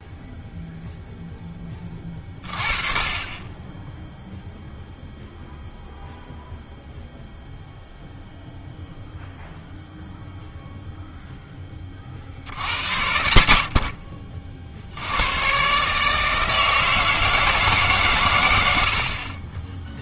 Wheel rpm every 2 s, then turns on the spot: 0, 40, 0, 0, 0, 0, 90, 60, 160, 90.
none